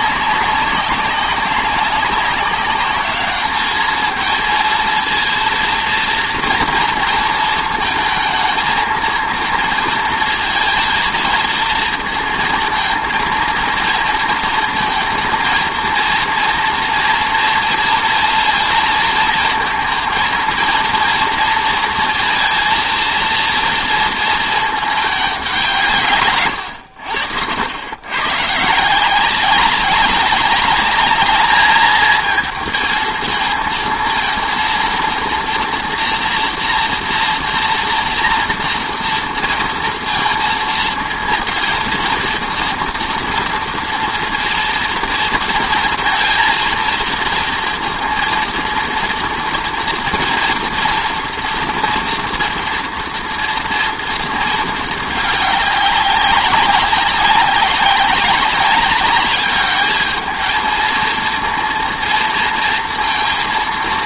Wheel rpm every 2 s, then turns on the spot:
190, 200, 230, 230, 230, 230, 230, 230, 230, 230, 230, 230, 220, 100, 140, 200, 230, 230, 230, 230, 230, 230, 230, 230, 230, 240, 230, 220, 190, 200, 230, 230.
none